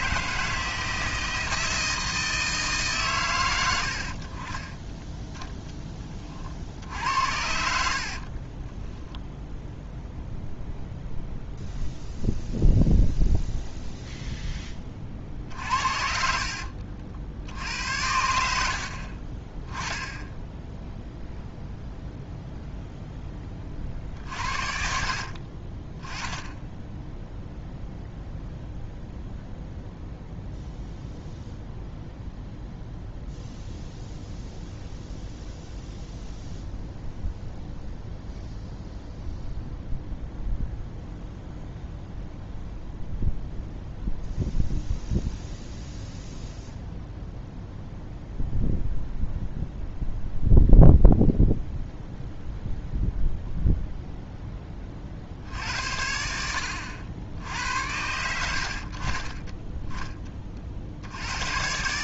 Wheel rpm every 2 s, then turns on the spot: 160, 150, 10, 60, 30, 0, 0, 20, 60, 60, 0, 0, 50, 10, 0, 0, 0, 0, 0, 0, 0, 0, 0, 0, 0, 0, 0, 20, 80, 60, 50.
8-10 16-18